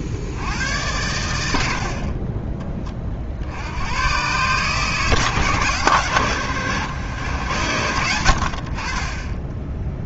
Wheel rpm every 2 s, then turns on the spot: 90, 30, 140, 100, 40.
none